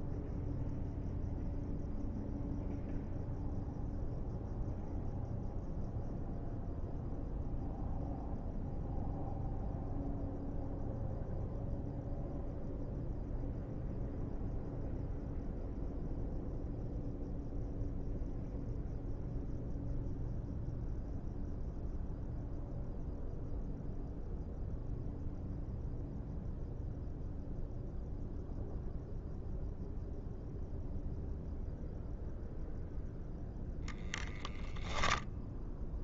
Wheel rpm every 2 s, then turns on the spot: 0, 0, 0, 0, 0, 0, 0, 0, 0, 0, 0, 0, 0, 0, 0, 0, 0, 0.
none